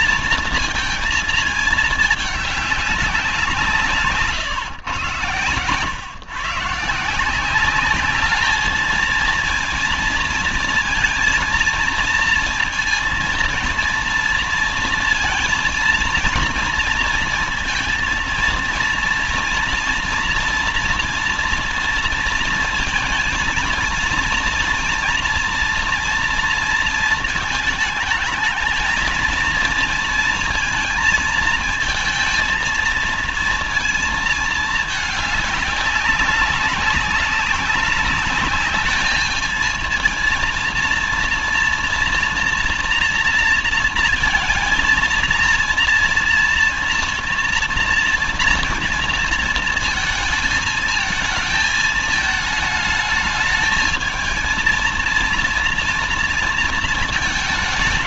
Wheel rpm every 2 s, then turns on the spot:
230, 210, 130, 140, 210, 230, 230, 230, 230, 230, 230, 230, 230, 230, 220, 230, 220, 220, 200, 210, 230, 240, 230, 240, 240, 220, 220, 220, 230.
none